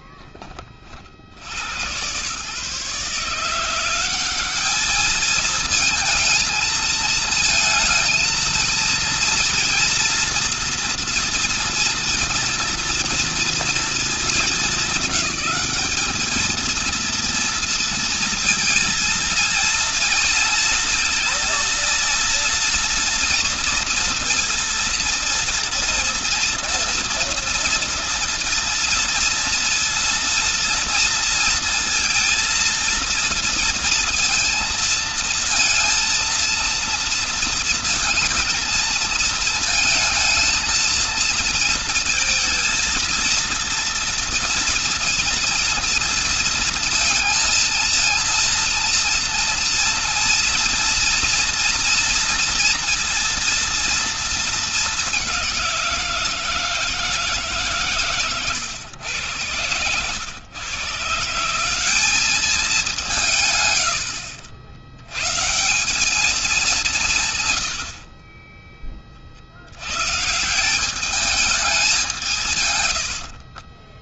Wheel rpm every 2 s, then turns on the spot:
30, 130, 200, 220, 230, 240, 230, 210, 230, 230, 230, 230, 230, 240, 230, 230, 230, 230, 230, 230, 230, 230, 230, 230, 230, 230, 230, 220, 170, 130, 110, 200, 80, 200, 20, 160, 160.
none